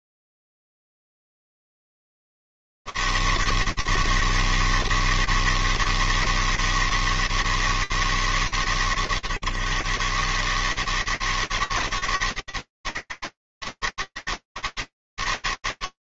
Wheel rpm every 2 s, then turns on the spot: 90, 160, 160, 160, 150, 140, 160, 160.
none